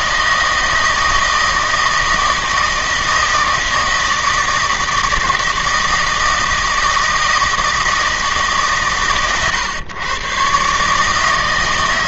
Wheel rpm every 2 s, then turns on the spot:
160, 160, 160, 160, 130, 140.
none